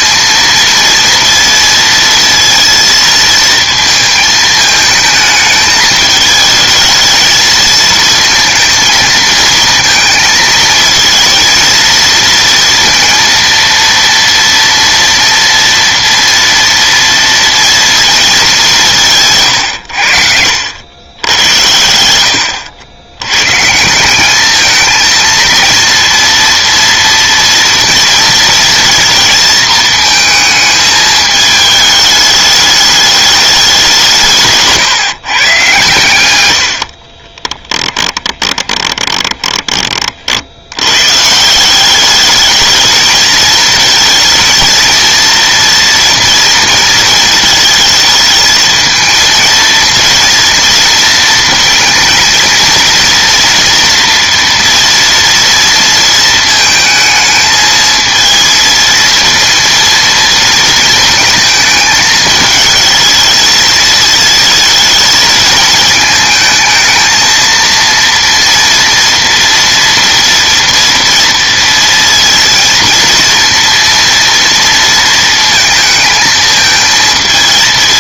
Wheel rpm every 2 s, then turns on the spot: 230, 230, 220, 220, 220, 220, 230, 230, 230, 190, 90, 80, 220, 230, 230, 220, 210, 150, 80, 20, 80, 220, 230, 230, 230, 230, 230, 230, 220, 230, 220, 220, 220, 220, 230, 230, 230, 230, 220.
36-40